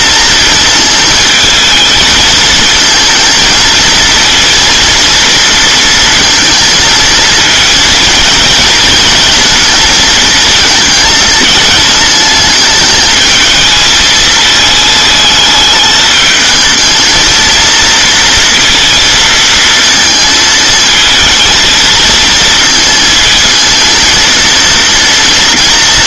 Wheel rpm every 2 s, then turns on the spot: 230, 220, 230, 230, 220, 220, 220, 220, 220, 230, 230, 230, 230.
none